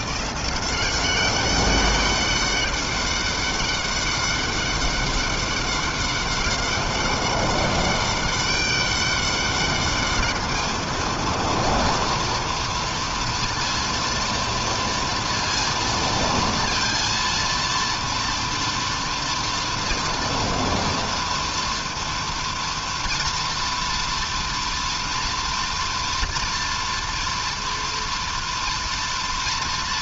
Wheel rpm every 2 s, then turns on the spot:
190, 200, 200, 200, 200, 230, 230, 230, 230, 230, 230, 230, 230, 230, 230.
none